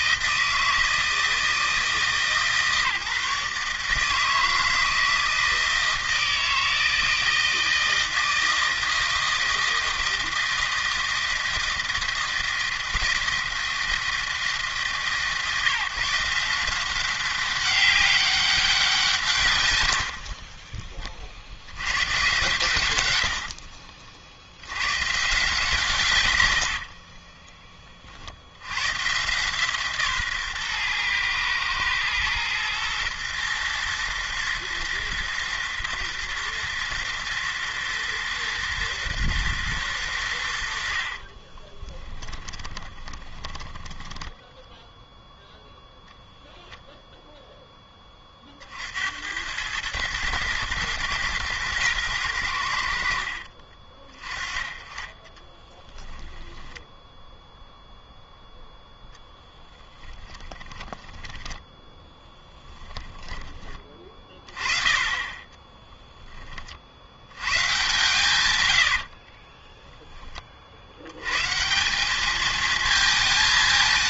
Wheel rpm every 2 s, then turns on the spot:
160, 150, 160, 160, 160, 160, 160, 150, 170, 190, 30, 120, 90, 80, 90, 130, 120, 110, 110, 120, 80, 20, 10, 0, 50, 110, 80, 20, 10, 0, 10, 10, 20, 40, 100, 50, 220.
20-22 26-28 42-46 56-58 60-64